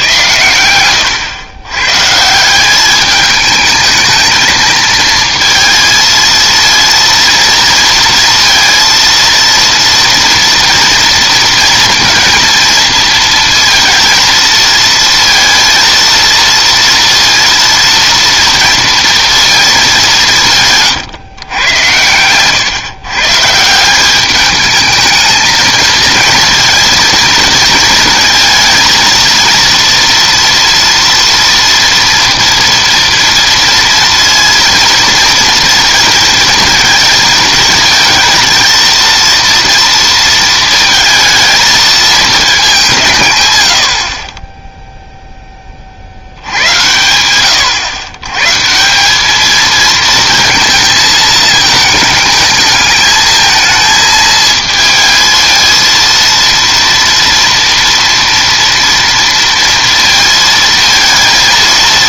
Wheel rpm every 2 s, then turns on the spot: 110, 170, 220, 230, 230, 230, 230, 230, 230, 230, 170, 120, 210, 230, 230, 230, 230, 230, 220, 230, 230, 210, 20, 80, 150, 230, 210, 220, 230, 230, 230.
none